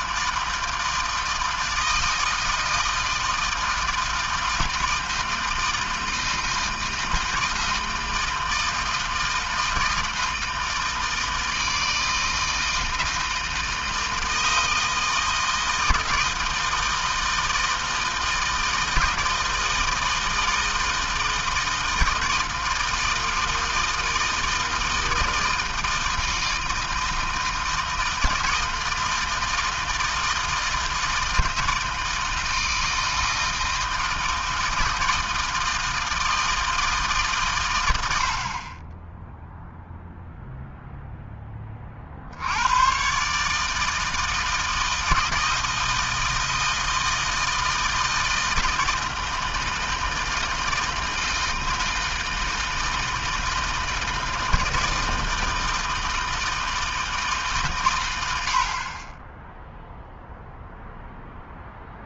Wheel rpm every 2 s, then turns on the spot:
160, 160, 160, 160, 160, 160, 160, 160, 160, 160, 160, 160, 160, 160, 160, 160, 160, 160, 150, 10, 0, 130, 160, 160, 160, 160, 160, 160, 160, 30, 0.
none